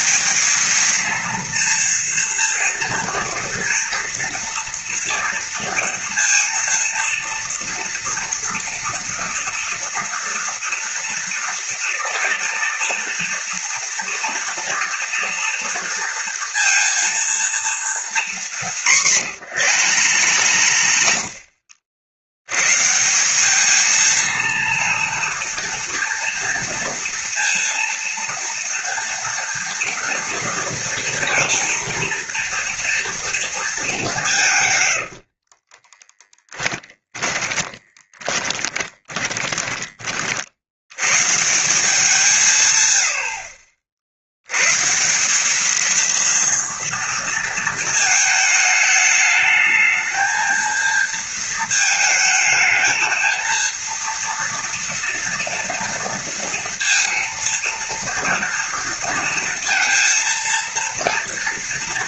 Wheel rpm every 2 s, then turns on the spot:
220, 230, 230, 230, 230, 230, 230, 230, 230, 190, 70, 150, 230, 230, 230, 230, 230, 110, 10, 10, 100, 130, 140, 230, 210, 230, 220, 230, 230, 230, 230.
18-22 34-40